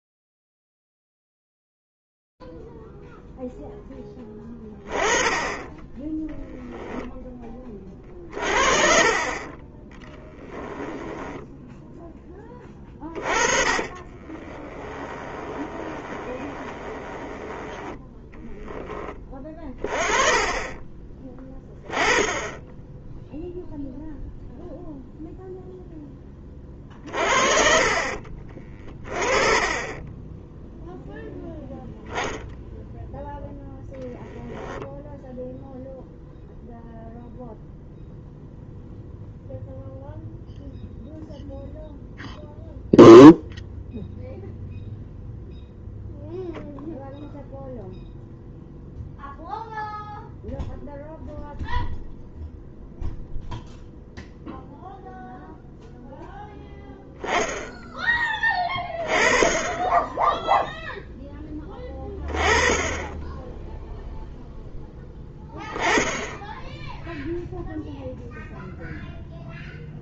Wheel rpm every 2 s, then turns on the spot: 0, 0, 10, 10, 30, 10, 20, 30, 20, 10, 20, 10, 0, 20, 20, 0, 0, 0, 0, 0, 0, 0, 0, 0, 0, 0, 0, 0, 0, 20, 0, 20, 0, 0, 0.
10-12 14-18